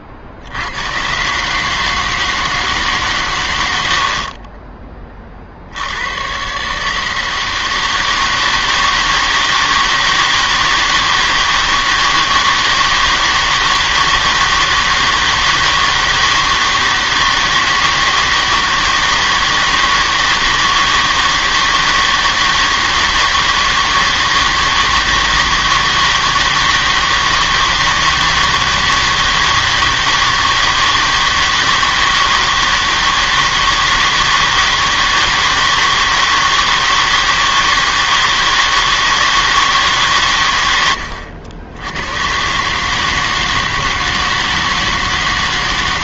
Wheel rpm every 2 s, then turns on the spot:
90, 150, 20, 140, 160, 160, 160, 160, 160, 160, 160, 160, 160, 160, 160, 160, 160, 160, 160, 160, 110, 140, 160.
4-6